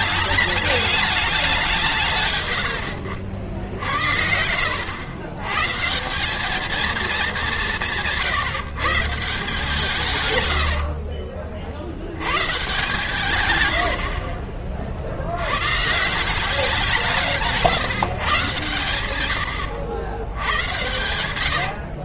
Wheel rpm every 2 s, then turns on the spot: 210, 110, 70, 190, 150, 110, 130, 70, 180, 130, 90.
2-4 10-12